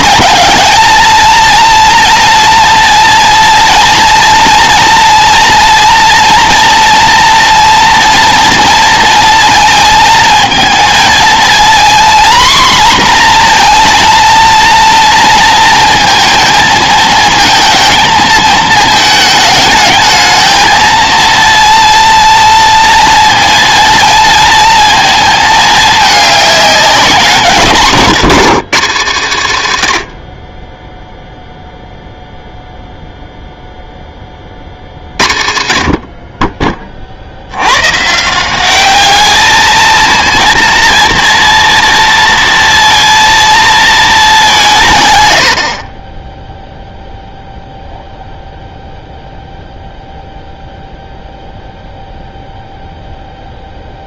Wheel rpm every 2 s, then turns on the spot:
220, 230, 230, 230, 230, 220, 240, 230, 220, 220, 220, 230, 230, 190, 180, 20, 0, 70, 30, 200, 230, 230, 160, 0, 0, 0, 0.
none